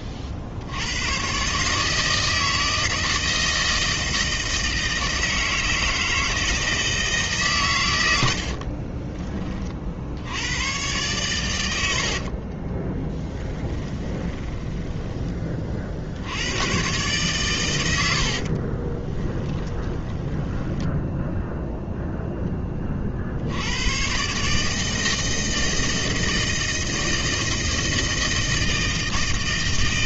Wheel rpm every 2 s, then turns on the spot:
70, 160, 160, 160, 50, 100, 30, 10, 110, 50, 10, 10, 150, 160, 160.
8-10 12-16 18-22